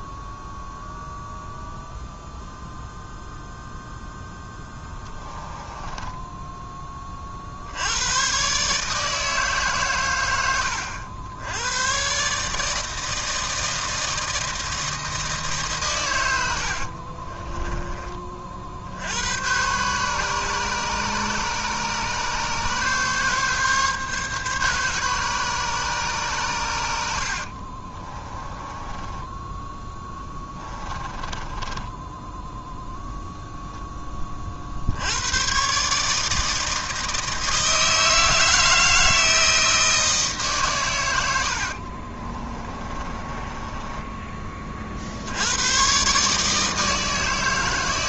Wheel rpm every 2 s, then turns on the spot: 0, 0, 10, 10, 130, 100, 150, 160, 80, 50, 140, 140, 140, 110, 20, 20, 10, 40, 160, 160, 150, 30, 30, 150.
4-6 28-34 42-44